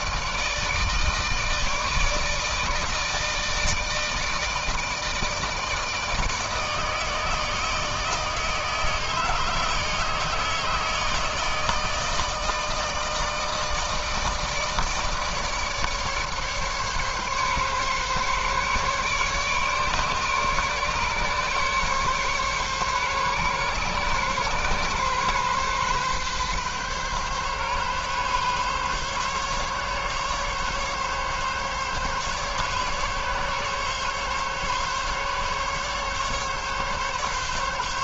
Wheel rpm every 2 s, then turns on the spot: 160, 160, 160, 160, 160, 160, 160, 150, 140, 140, 140, 140, 130, 140, 140, 140, 140, 140, 140.
none